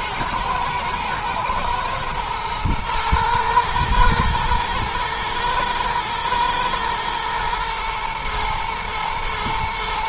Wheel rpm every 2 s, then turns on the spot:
110, 110, 110, 120, 110.
none